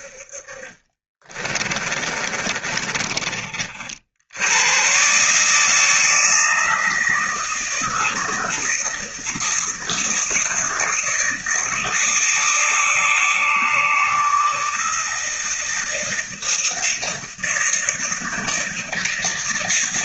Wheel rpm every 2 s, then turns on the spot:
40, 30, 110, 160, 170, 170, 160, 160, 160, 160.
0-4